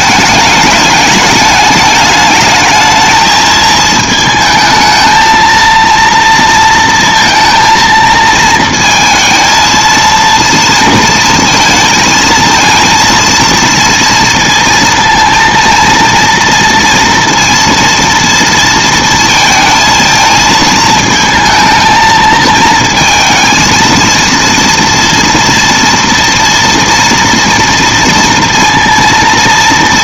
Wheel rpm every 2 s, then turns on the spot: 210, 220, 220, 230, 230, 230, 230, 230, 230, 230, 220, 230, 230, 240, 230.
none